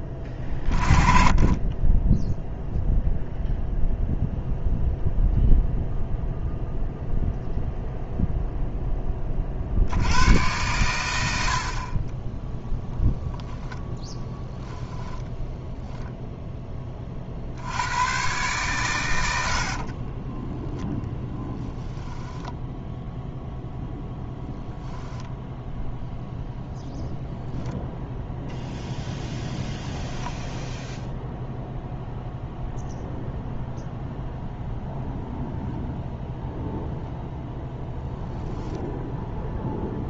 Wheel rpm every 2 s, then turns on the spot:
20, 0, 0, 0, 0, 100, 0, 10, 20, 120, 0, 0, 0, 0, 0, 0, 0, 0, 0, 0.
14-16